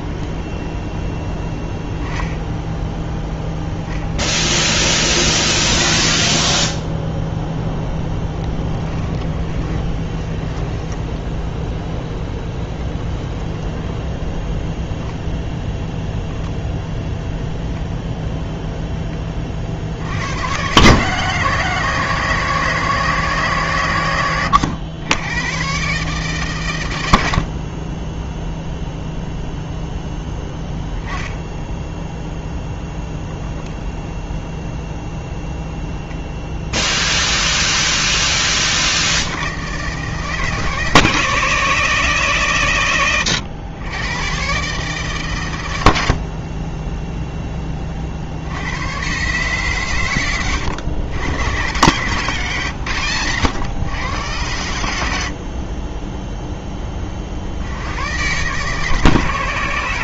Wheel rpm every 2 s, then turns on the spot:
10, 0, 20, 0, 10, 10, 0, 0, 0, 20, 140, 150, 90, 110, 0, 10, 0, 0, 0, 70, 150, 110, 150, 20, 130, 110, 130, 80, 40, 150.
8-12